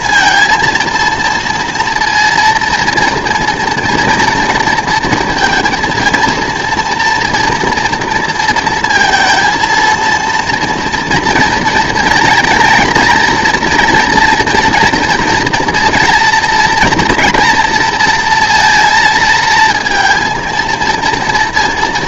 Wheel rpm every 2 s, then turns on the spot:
230, 240, 230, 230, 230, 230, 230, 230, 230, 230, 230.
none